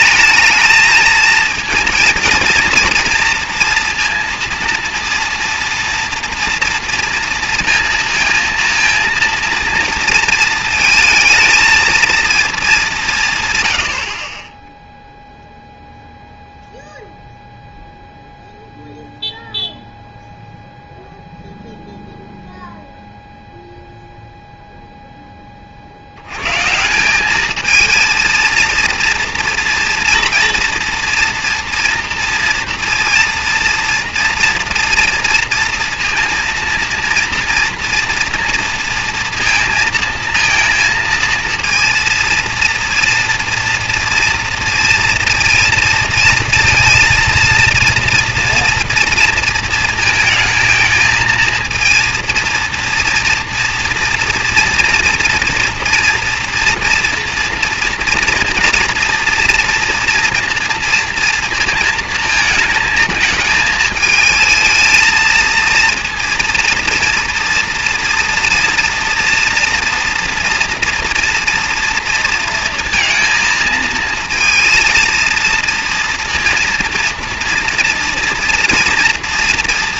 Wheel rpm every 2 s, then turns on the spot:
220, 230, 230, 230, 230, 230, 200, 10, 0, 0, 0, 0, 0, 130, 230, 230, 230, 230, 230, 230, 230, 230, 230, 230, 240, 220, 230, 230, 240, 230, 230, 220, 220, 230, 240, 230, 230, 230, 230, 230.
none